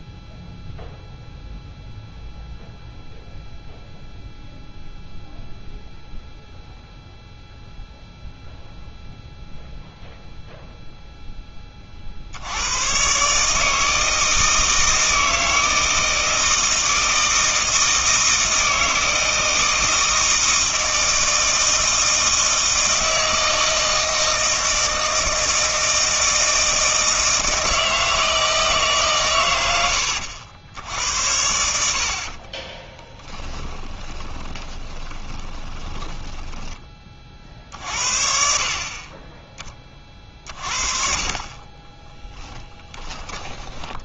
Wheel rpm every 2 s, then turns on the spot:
0, 0, 0, 0, 0, 0, 90, 160, 160, 160, 160, 160, 160, 160, 160, 80, 30, 20, 10, 50, 40, 10.
32-36